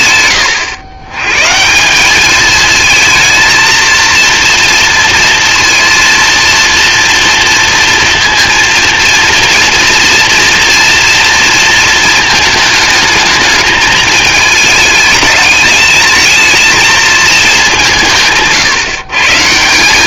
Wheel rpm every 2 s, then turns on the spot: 110, 220, 230, 230, 230, 230, 220, 210, 220, 150.
none